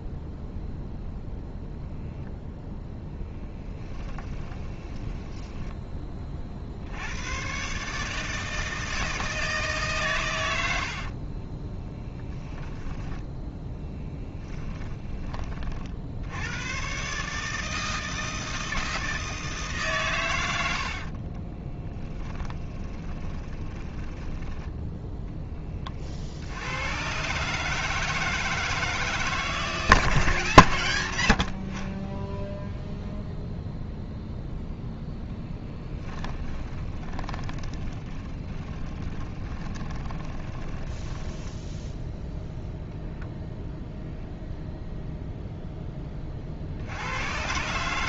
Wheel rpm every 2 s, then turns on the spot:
0, 0, 20, 70, 160, 60, 10, 20, 120, 160, 70, 20, 10, 90, 160, 110, 0, 0, 20, 20, 10, 0, 0, 70.
4-6 10-12 14-16 20-26 36-42